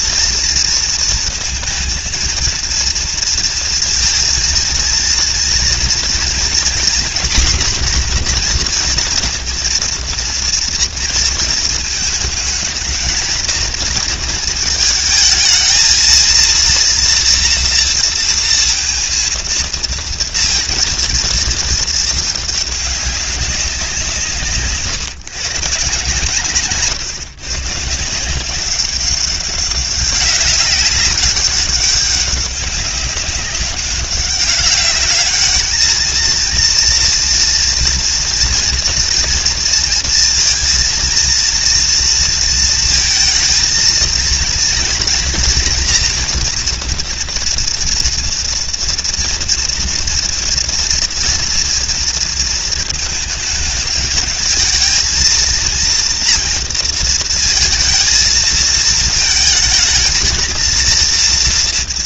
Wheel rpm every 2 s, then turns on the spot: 230, 230, 230, 240, 240, 230, 220, 220, 230, 230, 230, 200, 150, 140, 190, 200, 190, 200, 230, 230, 230, 220, 230, 230, 230, 230, 230, 220, 230, 220, 230.
26-28